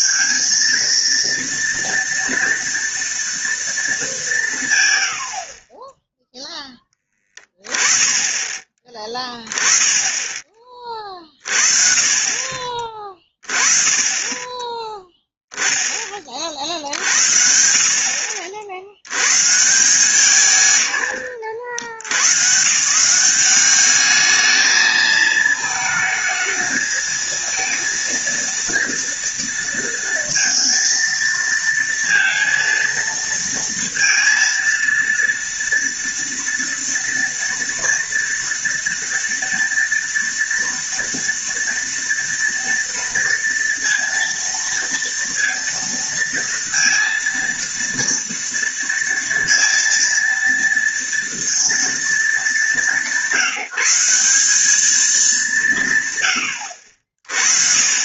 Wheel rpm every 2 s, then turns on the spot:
230, 230, 170, 0, 20, 20, 30, 20, 40, 50, 160, 130, 220, 220, 230, 230, 230, 230, 230, 230, 230, 230, 230, 230, 230, 230, 220, 200, 90.
none